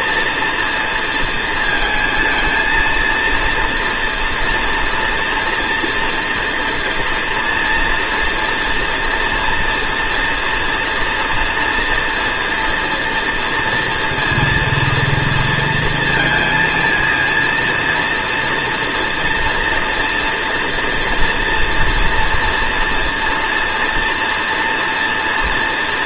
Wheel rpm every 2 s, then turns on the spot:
230, 230, 230, 230, 230, 230, 230, 230, 230, 230, 230, 240, 230.
none